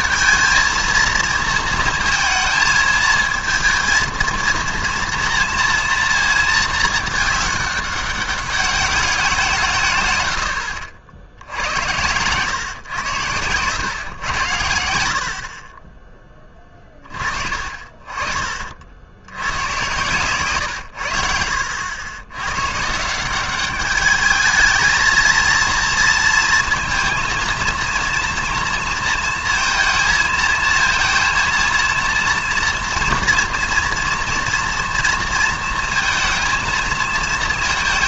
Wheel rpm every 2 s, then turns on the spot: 230, 220, 230, 220, 200, 80, 120, 90, 20, 40, 120, 110, 210, 230, 230, 220, 230, 230, 230.
none